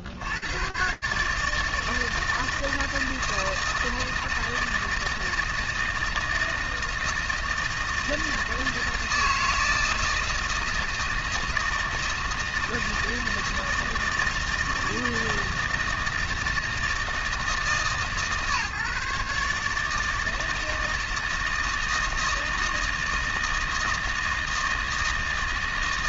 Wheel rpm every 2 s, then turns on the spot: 70, 160, 160, 160, 160, 160, 160, 160, 160, 150, 160, 160, 160.
none